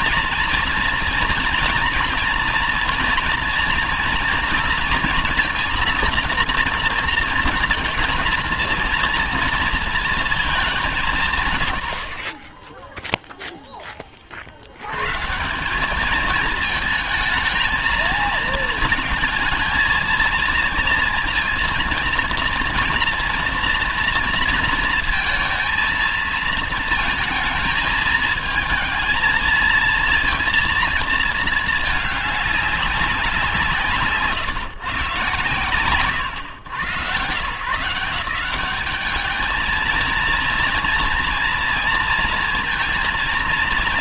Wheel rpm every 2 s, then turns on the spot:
230, 230, 230, 230, 230, 200, 20, 70, 220, 220, 230, 230, 230, 220, 220, 230, 200, 140, 120, 190, 230, 230.
none